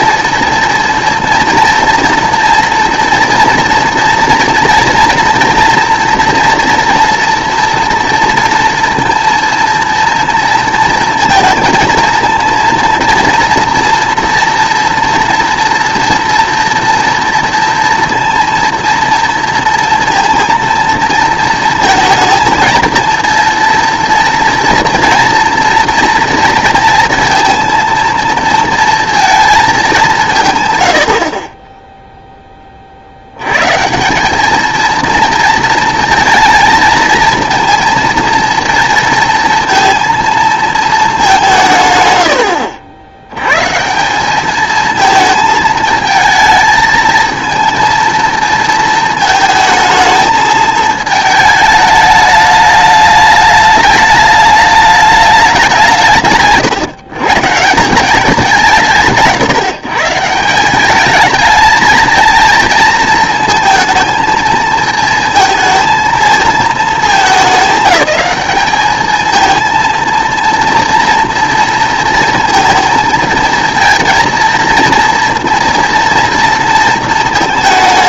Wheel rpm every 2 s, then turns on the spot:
230, 230, 230, 230, 230, 230, 230, 240, 230, 230, 230, 230, 230, 230, 230, 120, 30, 220, 230, 230, 220, 90, 220, 220, 230, 220, 210, 210, 150, 180, 180, 230, 220, 220, 210, 230, 220, 230, 230.
none